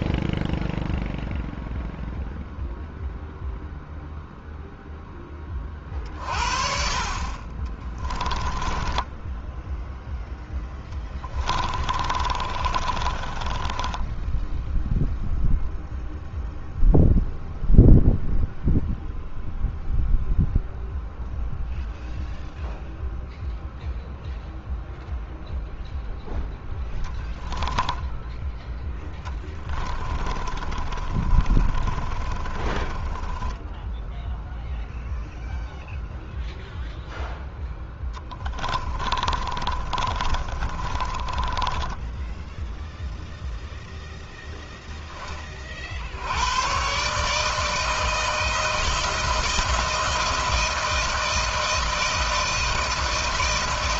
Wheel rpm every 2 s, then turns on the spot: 0, 0, 0, 50, 20, 10, 30, 0, 0, 0, 0, 0, 0, 10, 10, 30, 30, 0, 0, 20, 30, 0, 0, 120, 160, 160, 160.
8-14 26-28 30-34 38-42